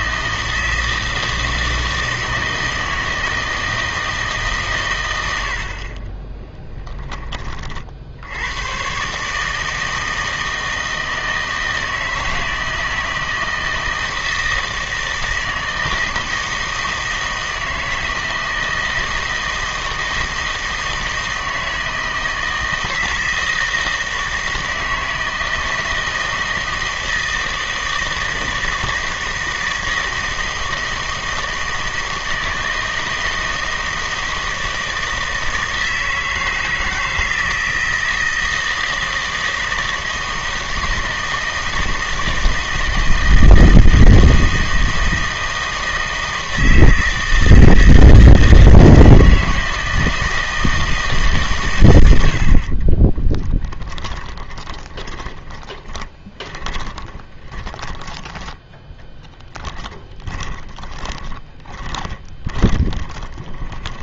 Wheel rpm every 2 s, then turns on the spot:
160, 160, 130, 10, 120, 160, 160, 160, 160, 160, 160, 160, 160, 160, 160, 160, 160, 160, 160, 160, 160, 160, 160, 160, 160, 160, 40, 20, 20, 10, 20, 20.
52-58 60-64